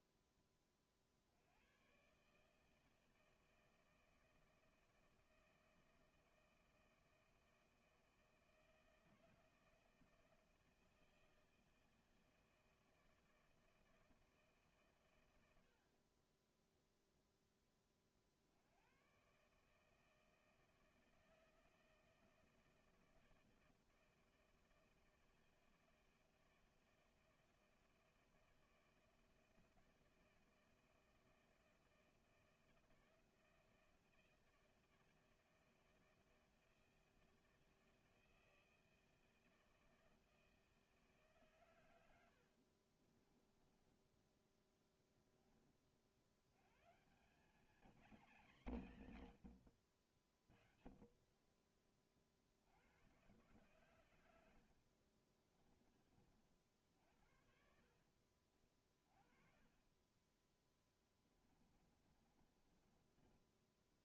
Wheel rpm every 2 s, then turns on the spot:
10, 150, 160, 160, 160, 160, 160, 160, 20, 70, 160, 160, 160, 160, 160, 160, 160, 160, 160, 160, 160, 70, 10, 80, 230, 40, 50, 90, 50, 50, 20, 30.
16-18 42-46 58-60 62-64